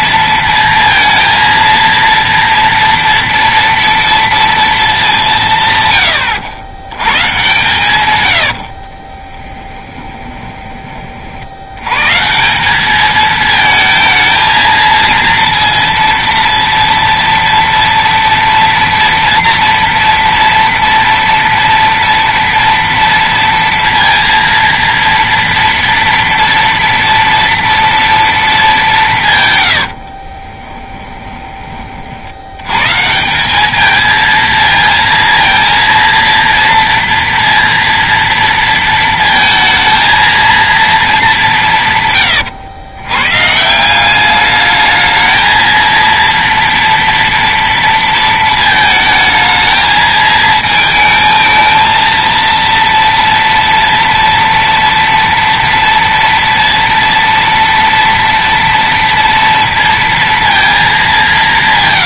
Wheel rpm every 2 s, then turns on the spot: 230, 230, 230, 100, 70, 20, 190, 220, 230, 230, 240, 230, 230, 230, 210, 20, 110, 220, 230, 230, 230, 110, 210, 230, 220, 220, 230, 240, 230, 230, 220.
8-10 30-32